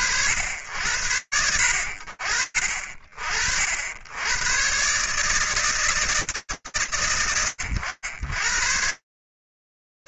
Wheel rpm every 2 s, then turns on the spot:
100, 60, 140, 110, 100.
none